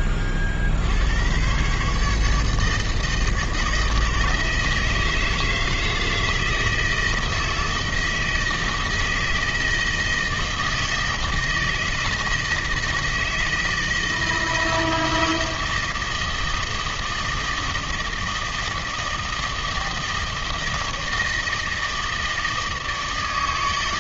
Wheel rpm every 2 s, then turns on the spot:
60, 150, 160, 160, 160, 160, 160, 160, 160, 160, 160, 160.
none